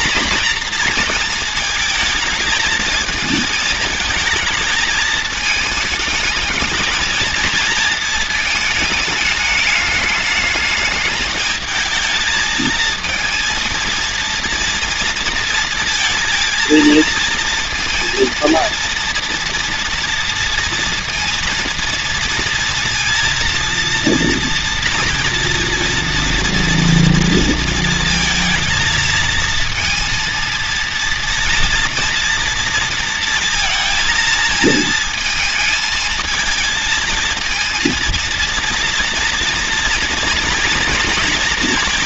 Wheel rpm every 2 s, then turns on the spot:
220, 220, 220, 230, 210, 220, 230, 230, 230, 230, 230, 230, 230, 220, 230, 230, 230, 220, 230, 230, 230.
none